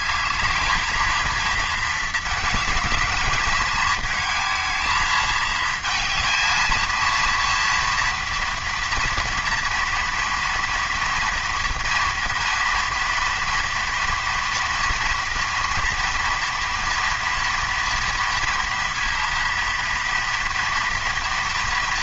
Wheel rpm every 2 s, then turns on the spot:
220, 210, 220, 230, 230, 230, 230, 240, 240, 230, 230.
none